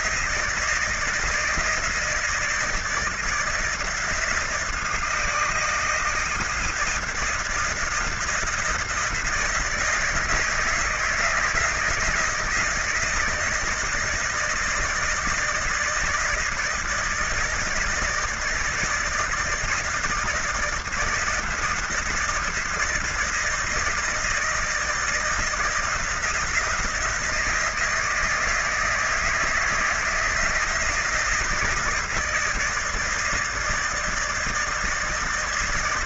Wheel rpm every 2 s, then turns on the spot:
160, 160, 160, 160, 170, 160, 160, 170, 160, 160, 160, 160, 160, 170, 160, 160, 160, 160.
none